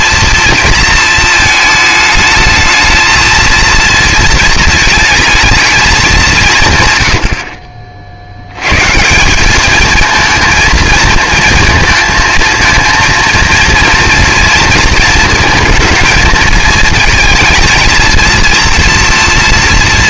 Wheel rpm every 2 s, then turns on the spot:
230, 220, 230, 140, 110, 220, 230, 230, 220, 230.
none